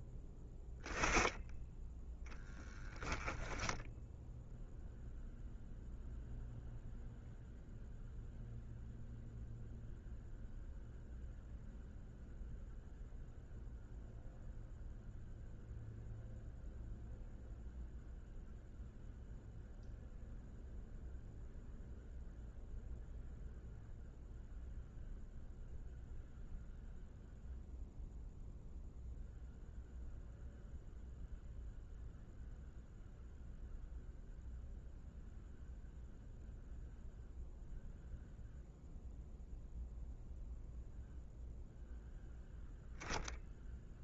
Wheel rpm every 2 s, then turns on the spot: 10, 0, 0, 0, 0, 0, 0, 0, 0, 0, 0, 0, 0, 0, 0, 0, 0, 0, 0, 0, 0, 0.
none